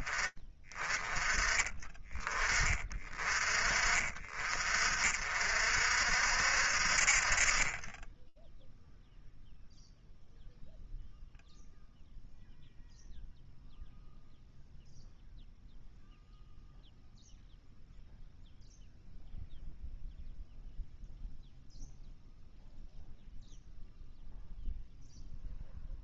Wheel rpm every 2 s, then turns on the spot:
20, 40, 60, 0, 0, 0, 0, 0, 0, 0, 0, 0, 0.
none